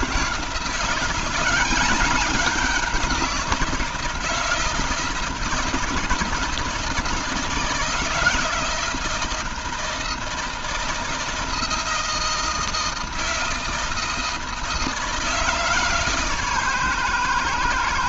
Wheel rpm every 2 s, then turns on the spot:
160, 190, 160, 160, 170, 160, 160, 160, 140.
none